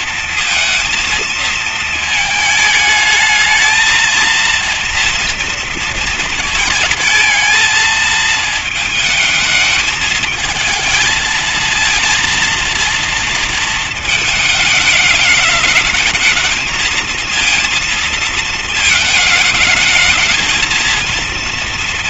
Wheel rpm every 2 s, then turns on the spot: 230, 220, 230, 230, 220, 220, 230, 220, 220, 220, 220.
none